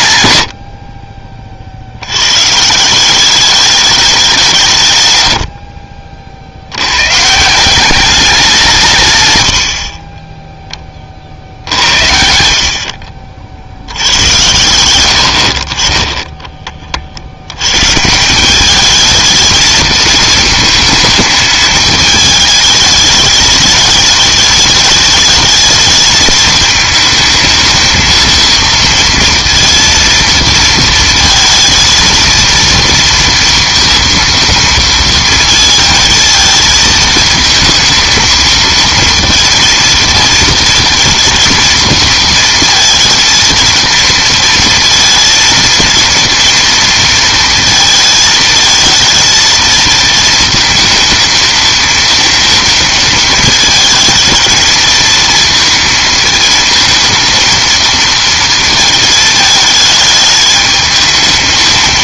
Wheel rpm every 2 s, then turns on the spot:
80, 140, 160, 70, 180, 10, 70, 110, 30, 200, 220, 210, 210, 220, 230, 230, 230, 230, 220, 230, 230, 230, 230, 230, 220, 230, 230, 230, 220, 230, 210.
none